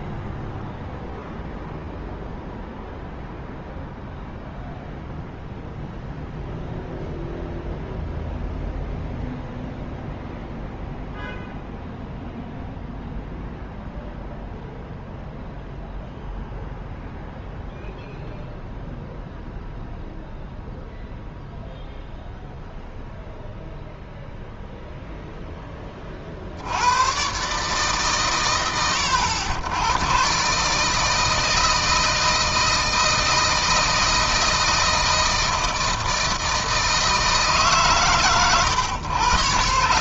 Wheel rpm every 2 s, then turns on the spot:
0, 0, 0, 0, 0, 0, 0, 0, 0, 0, 0, 0, 0, 100, 90, 150, 160, 160, 160, 120.
none